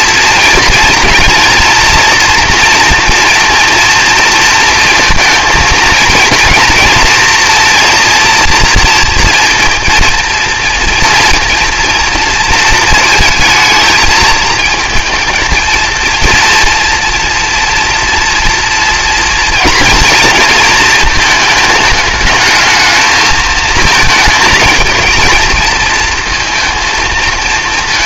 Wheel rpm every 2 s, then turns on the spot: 230, 230, 230, 230, 230, 230, 230, 230, 230, 230, 230, 220, 220, 230.
none